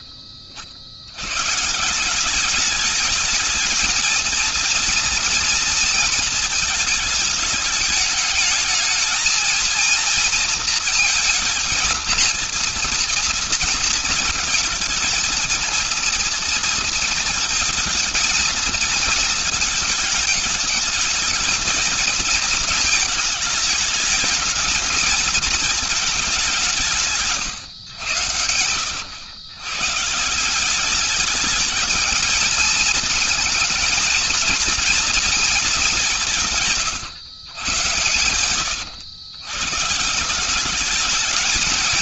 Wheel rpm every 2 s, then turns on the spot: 70, 200, 230, 220, 220, 230, 230, 230, 230, 220, 210, 220, 210, 190, 110, 180, 220, 230, 150, 100, 190.
none